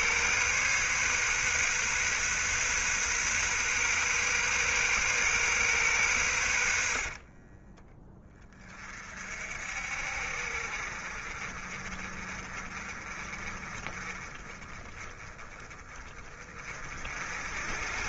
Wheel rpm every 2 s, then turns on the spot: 130, 130, 130, 60, 40, 50, 30, 20, 50.
6-8